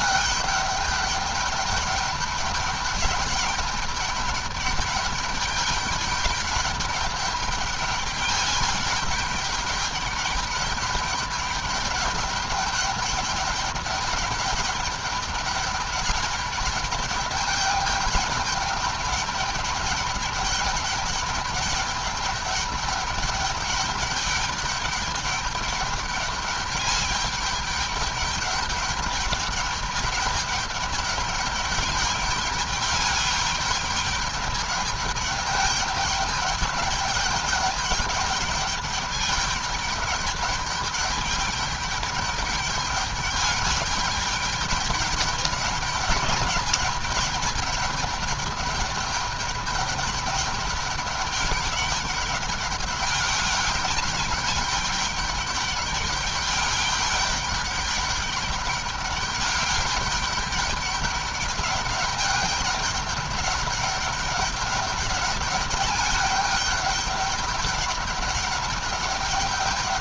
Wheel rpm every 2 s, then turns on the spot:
200, 210, 210, 210, 210, 200, 200, 210, 210, 200, 200, 200, 210, 210, 210, 200, 200, 200, 200, 200, 200, 210, 210, 210, 200, 200, 200, 210, 200, 200, 210, 200, 200, 210, 200.
none